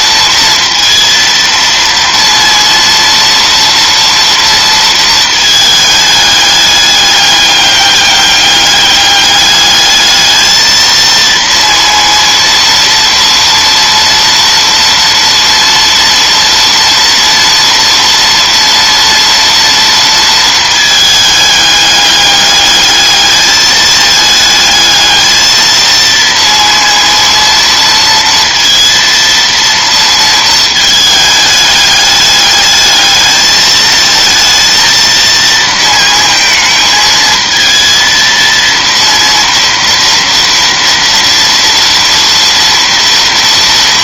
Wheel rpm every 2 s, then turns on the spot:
230, 230, 230, 210, 200, 220, 230, 230, 230, 230, 220, 210, 220, 230, 230, 220, 210, 230, 220, 230, 230, 230.
none